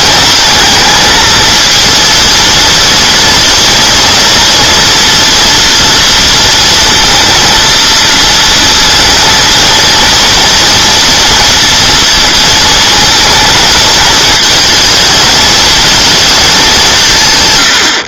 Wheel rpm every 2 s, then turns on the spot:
230, 230, 230, 230, 230, 230, 230, 220, 190.
none